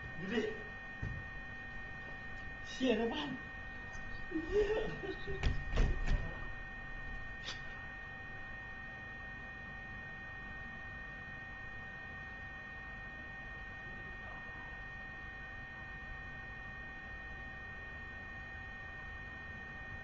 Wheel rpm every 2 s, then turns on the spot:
0, 0, 0, 0, 0, 0, 0, 0, 0, 0.
none